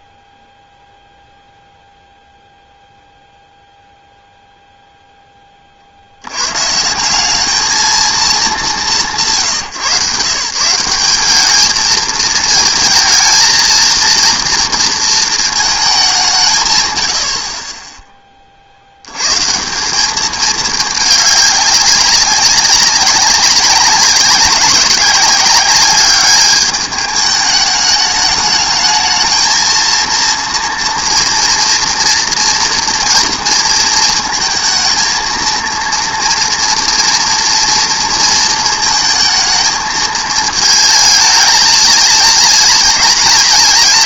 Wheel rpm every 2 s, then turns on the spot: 0, 0, 0, 120, 200, 150, 220, 230, 140, 40, 210, 190, 190, 210, 210, 230, 230, 220, 230, 230, 220, 220.
none